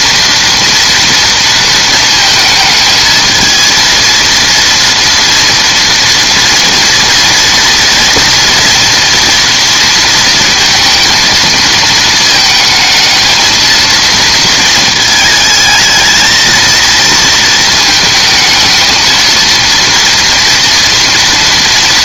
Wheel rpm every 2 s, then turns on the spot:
230, 220, 230, 230, 230, 230, 220, 230, 230, 220, 230.
none